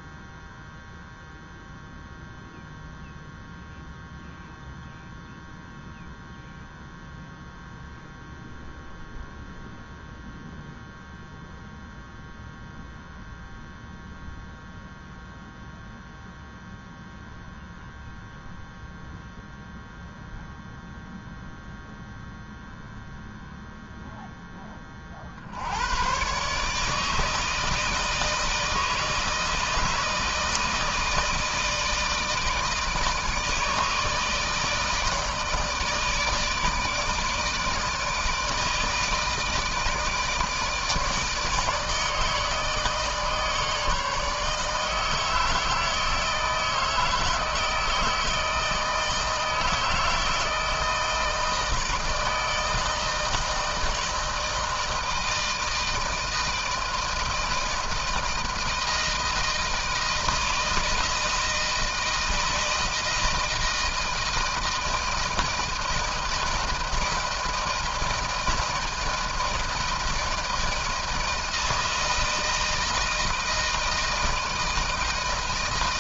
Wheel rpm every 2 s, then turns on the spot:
0, 0, 0, 0, 0, 0, 0, 0, 0, 0, 0, 0, 30, 150, 160, 160, 160, 160, 160, 160, 160, 160, 150, 160, 160, 160, 160, 160, 160, 160, 160, 160, 160, 160, 160, 160, 160, 160.
none